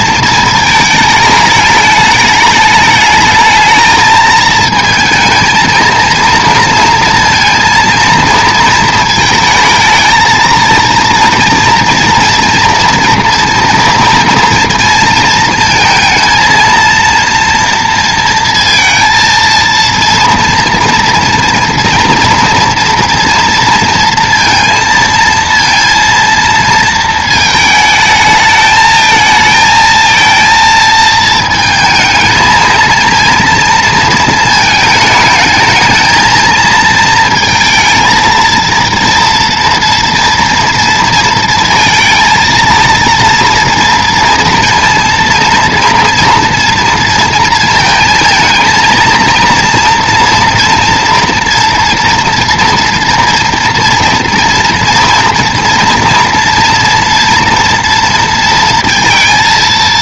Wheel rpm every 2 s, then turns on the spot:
220, 210, 220, 230, 230, 230, 230, 230, 230, 230, 230, 230, 230, 230, 220, 230, 220, 220, 230, 230, 230, 230, 230, 230, 230, 240, 230, 230, 230, 230.
none